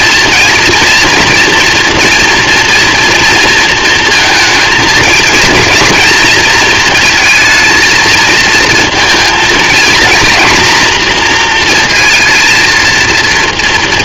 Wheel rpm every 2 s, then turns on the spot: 220, 230, 230, 230, 230, 240, 230.
none